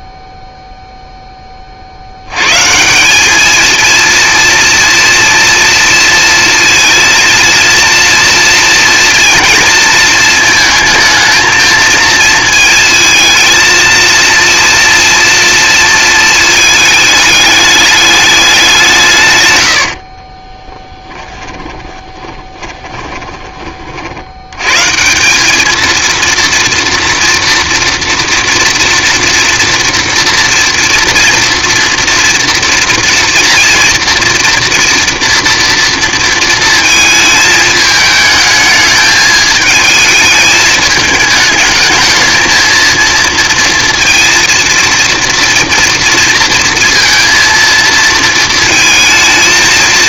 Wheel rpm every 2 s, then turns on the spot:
0, 140, 230, 230, 230, 220, 230, 230, 220, 180, 20, 20, 120, 230, 240, 230, 230, 240, 230, 220, 210, 220, 230, 230, 220.
20-24